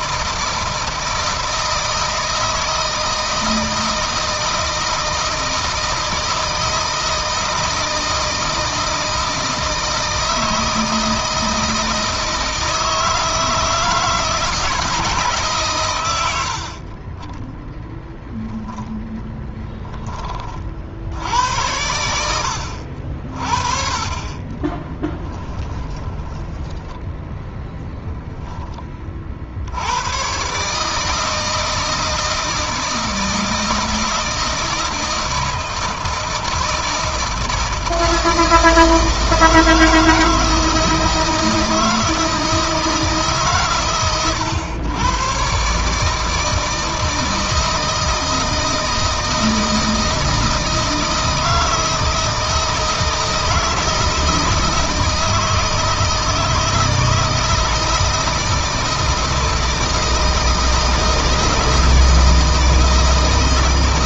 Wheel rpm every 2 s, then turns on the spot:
160, 160, 160, 160, 160, 160, 160, 150, 60, 0, 40, 70, 20, 10, 10, 130, 160, 160, 160, 160, 160, 160, 110, 160, 160, 160, 160, 160, 160, 160, 160, 160.
24-28